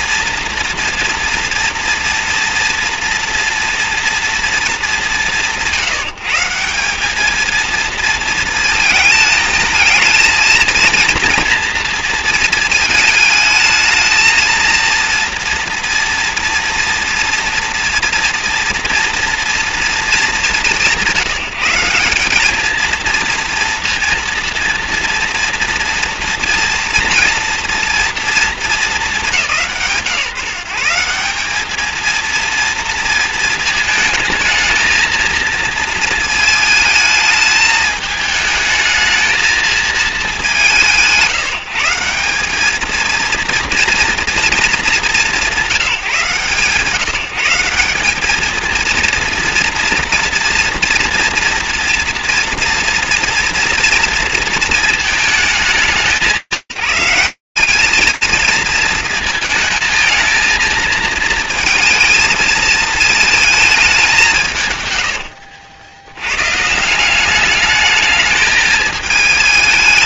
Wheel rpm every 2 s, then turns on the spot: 230, 230, 210, 190, 220, 230, 220, 230, 230, 230, 190, 220, 230, 230, 220, 160, 230, 220, 220, 220, 180, 210, 220, 150, 220, 230, 230, 230, 170, 220, 220, 220, 180, 110, 220.
none